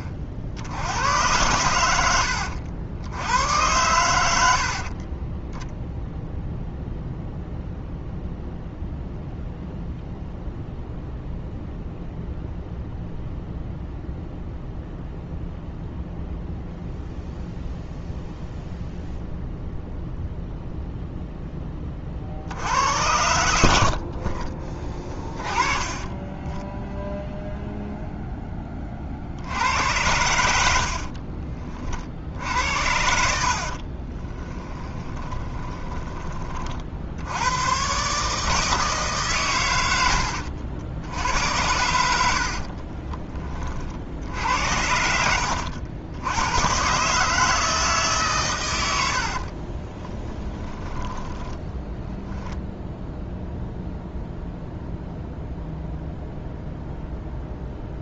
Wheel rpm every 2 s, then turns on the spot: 60, 80, 60, 0, 0, 0, 0, 0, 0, 0, 0, 60, 30, 10, 20, 70, 60, 10, 50, 160, 80, 40, 70, 120, 110, 20, 0, 0, 0.
30-36 42-46 50-52